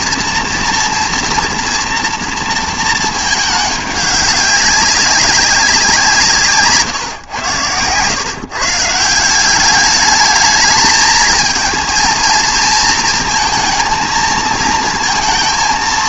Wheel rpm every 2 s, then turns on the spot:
230, 230, 200, 140, 150, 220, 220, 230.
none